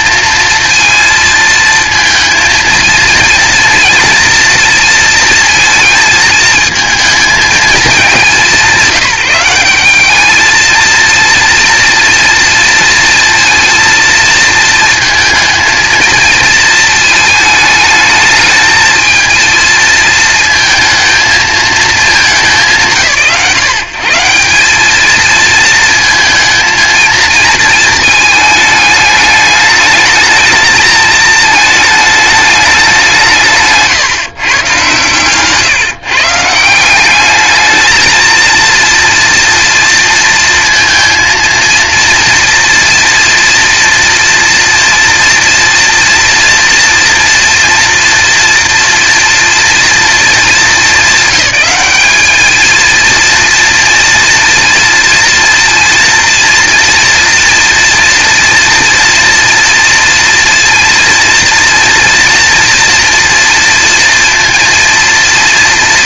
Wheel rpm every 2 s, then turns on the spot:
230, 230, 230, 220, 160, 230, 230, 220, 220, 220, 230, 150, 180, 230, 210, 220, 210, 130, 160, 230, 230, 230, 230, 240, 230, 200, 220, 240, 230, 230, 230, 230, 230.
none